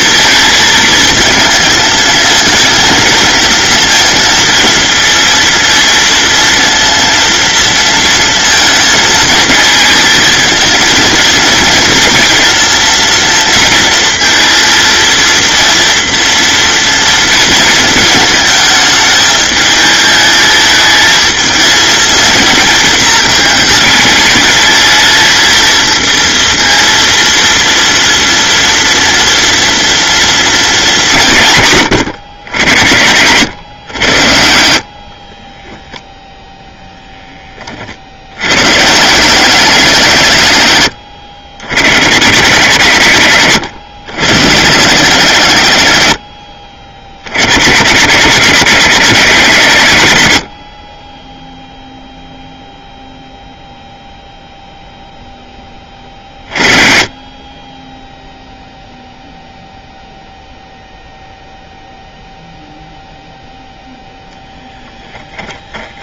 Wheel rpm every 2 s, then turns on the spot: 230, 220, 230, 230, 230, 220, 230, 230, 230, 220, 220, 230, 210, 230, 230, 210, 100, 60, 0, 100, 140, 150, 130, 80, 190, 50, 0, 0, 40, 0, 0, 0, 10.
none